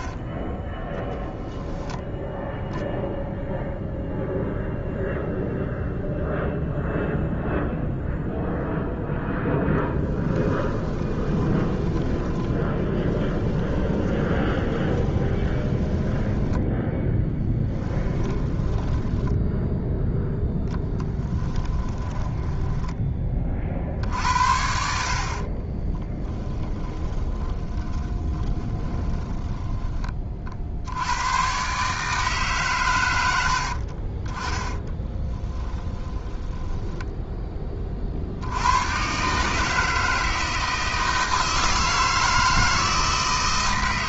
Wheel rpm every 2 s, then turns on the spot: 20, 0, 0, 0, 0, 10, 20, 20, 10, 10, 0, 10, 60, 10, 10, 50, 150, 20, 20, 80, 160, 160.
10-18 22-24 26-30 34-38